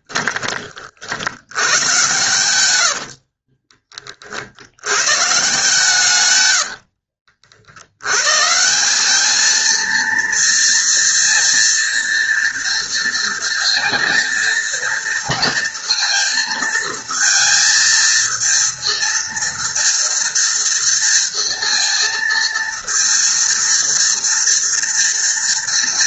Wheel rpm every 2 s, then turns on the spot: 60, 90, 120, 80, 190, 230, 230, 230, 220, 230, 230, 230, 230.
2-4 6-8